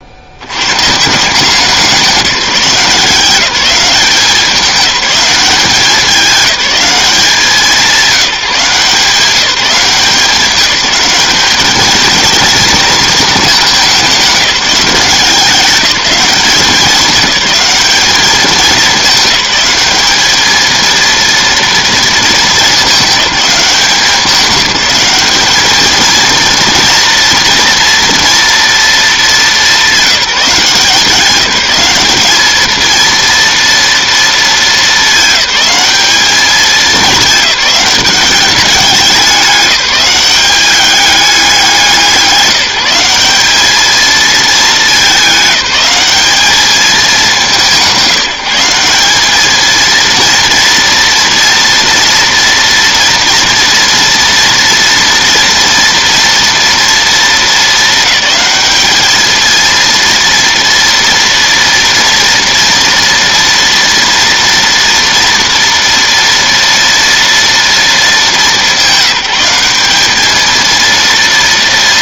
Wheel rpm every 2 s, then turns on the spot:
150, 170, 200, 190, 160, 190, 220, 180, 200, 200, 230, 210, 210, 230, 210, 180, 230, 210, 200, 190, 200, 190, 210, 210, 200, 230, 240, 230, 220, 220, 230, 230, 230, 230, 200, 230.
none